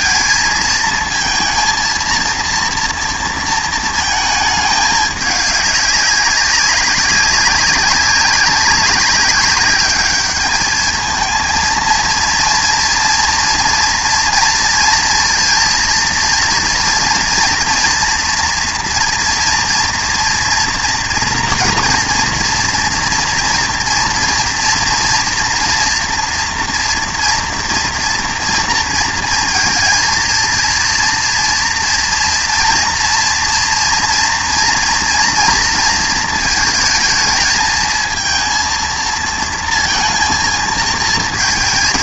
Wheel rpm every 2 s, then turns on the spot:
220, 230, 210, 190, 200, 210, 230, 230, 230, 240, 240, 230, 240, 230, 230, 230, 230, 230, 220, 230, 230.
none